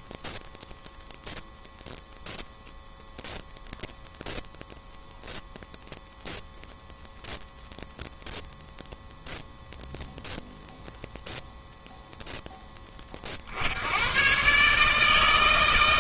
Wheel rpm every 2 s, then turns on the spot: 0, 0, 0, 0, 0, 0, 0, 130.
none